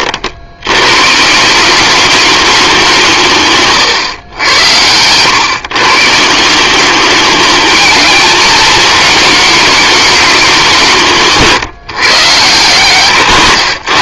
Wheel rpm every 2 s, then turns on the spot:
120, 180, 100, 200, 230, 170, 120.
none